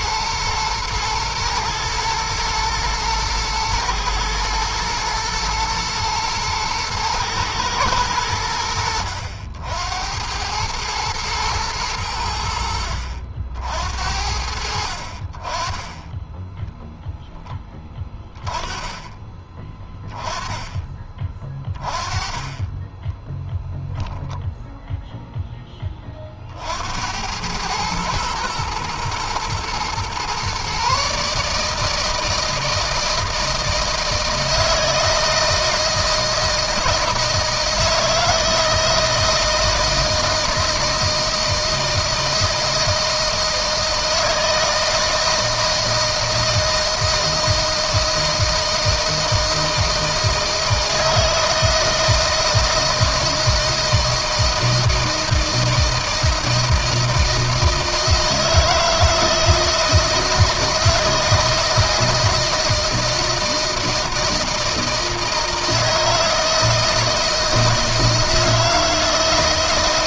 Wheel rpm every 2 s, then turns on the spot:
110, 120, 110, 120, 90, 100, 80, 70, 10, 10, 20, 20, 0, 60, 110, 130, 160, 160, 160, 160, 160, 160, 160, 160, 160, 160, 160, 160, 160, 160, 160, 160, 160, 160, 160.
16-18